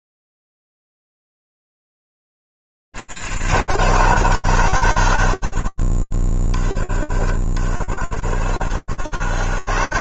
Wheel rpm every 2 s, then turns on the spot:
10, 110, 130, 40, 90.
8-10